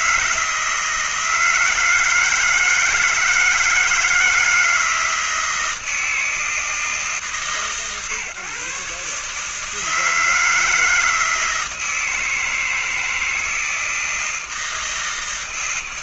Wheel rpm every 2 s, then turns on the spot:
160, 160, 160, 160, 140, 160, 160, 160.
none